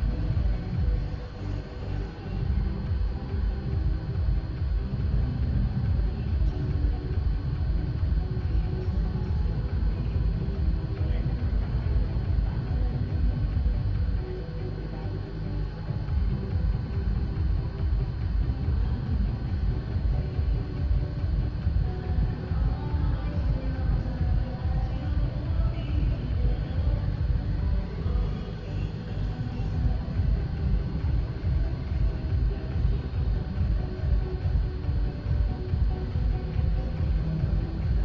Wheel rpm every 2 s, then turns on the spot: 0, 0, 0, 0, 0, 0, 0, 0, 0, 0, 0, 0, 0, 0, 0, 0, 0, 0, 0.
none